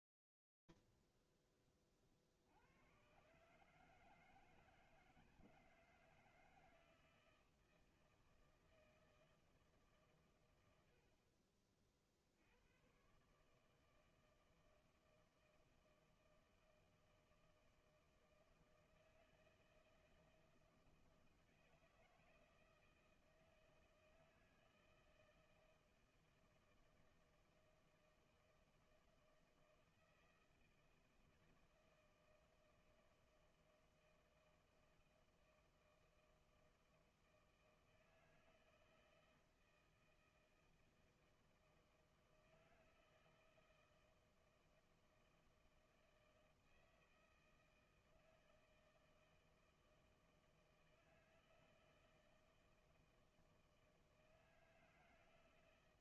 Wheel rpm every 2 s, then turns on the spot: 0, 20, 150, 160, 160, 130, 70, 160, 160, 160, 160, 160, 160, 160, 160, 160, 160, 160, 160, 160, 160, 160, 160, 160, 160, 160, 160, 160.
none